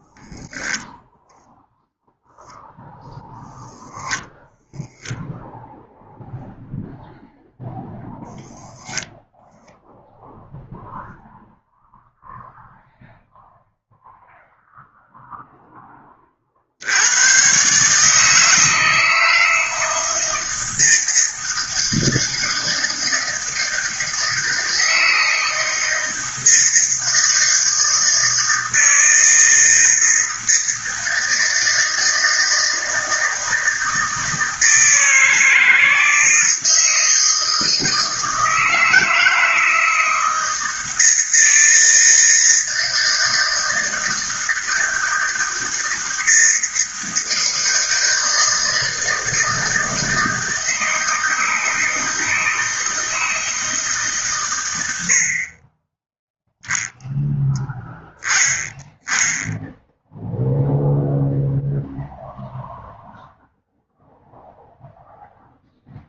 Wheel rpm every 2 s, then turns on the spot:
0, 0, 0, 0, 0, 0, 0, 0, 80, 160, 160, 160, 160, 160, 160, 160, 160, 160, 160, 160, 160, 160, 160, 160, 160, 160, 160, 80, 0, 10, 0, 0, 0.
none